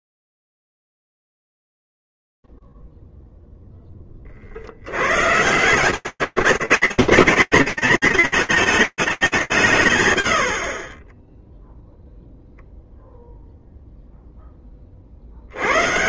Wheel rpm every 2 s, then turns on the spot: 0, 0, 0, 150, 160, 0, 0, 50.
none